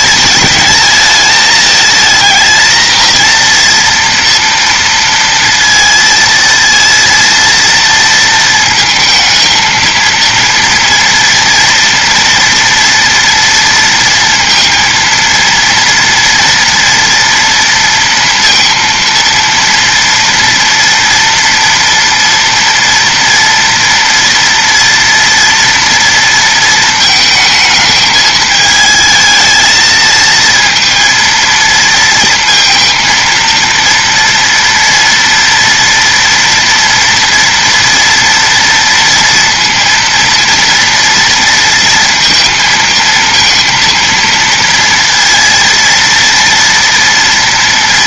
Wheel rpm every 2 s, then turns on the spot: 220, 230, 230, 230, 230, 230, 230, 230, 240, 230, 230, 230, 230, 220, 220, 230, 230, 230, 230, 230, 230, 220, 230, 230.
none